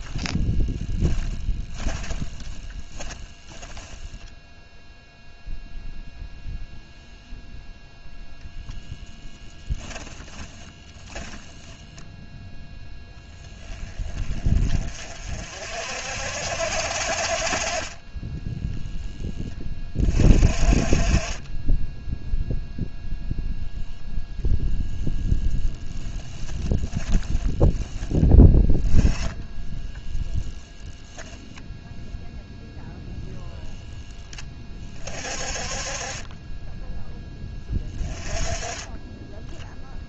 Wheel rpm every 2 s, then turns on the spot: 30, 20, 0, 0, 10, 10, 10, 40, 50, 10, 30, 0, 0, 10, 10, 0, 0, 30, 10, 20.
0-4 10-12 26-28